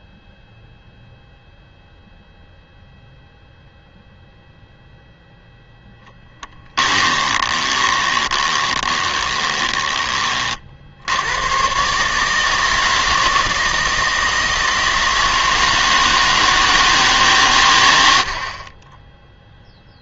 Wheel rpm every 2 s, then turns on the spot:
0, 0, 0, 10, 20, 70, 160, 160, 150, 20.
6-10